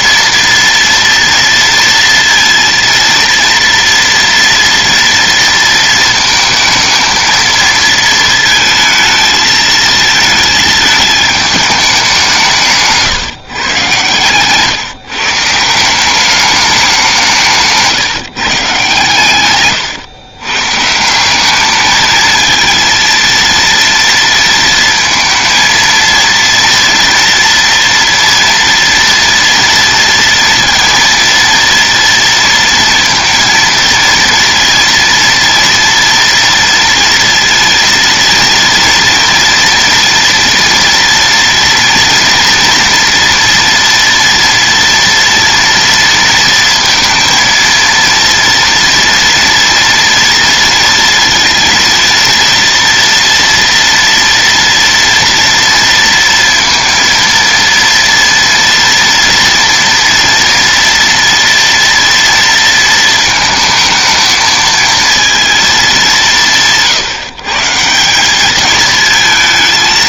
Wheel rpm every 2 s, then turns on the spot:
230, 230, 240, 220, 220, 220, 160, 150, 190, 130, 140, 230, 230, 230, 230, 230, 230, 230, 230, 230, 230, 230, 230, 230, 230, 230, 230, 230, 230, 230, 230, 230, 220, 150, 220.
none